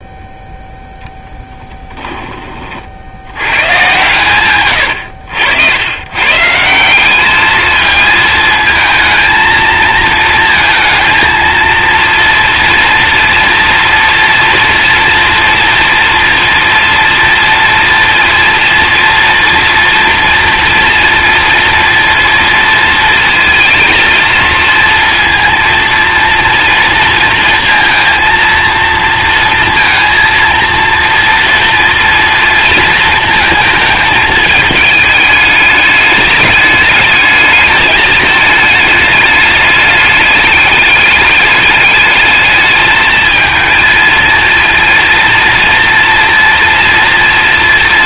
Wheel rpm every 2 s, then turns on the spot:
0, 60, 110, 180, 220, 230, 230, 230, 230, 230, 230, 230, 230, 230, 230, 230, 230, 210, 210, 220, 210, 210, 230, 230.
none